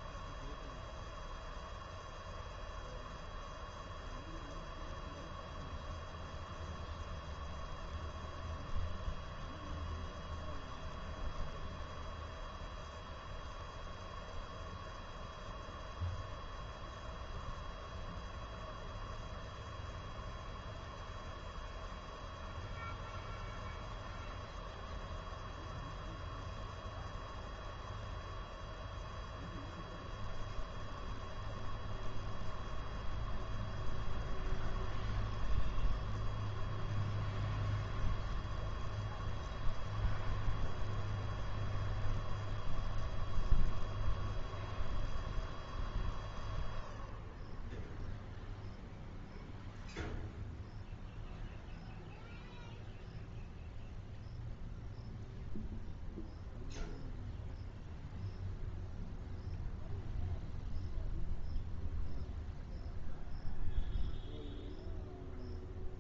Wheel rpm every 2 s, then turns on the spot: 0, 0, 0, 0, 0, 0, 0, 0, 0, 0, 0, 0, 0, 0, 0, 0, 0, 0, 0, 0, 0, 0, 0, 0, 0, 0, 0, 0, 0, 0, 0, 0, 0.
none